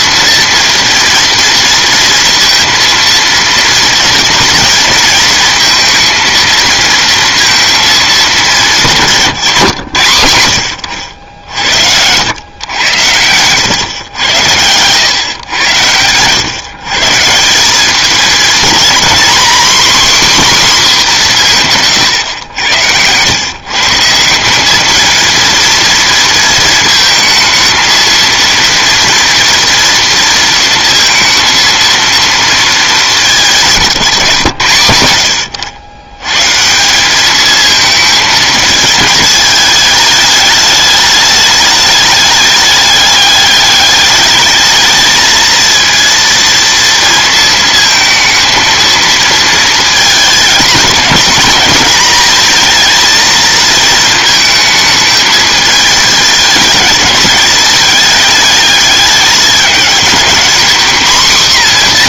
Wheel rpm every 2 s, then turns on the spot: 230, 230, 220, 230, 200, 80, 100, 100, 130, 220, 260, 100, 200, 230, 230, 230, 230, 120, 150, 220, 210, 210, 210, 230, 230, 220, 230, 220, 220, 210, 240.
none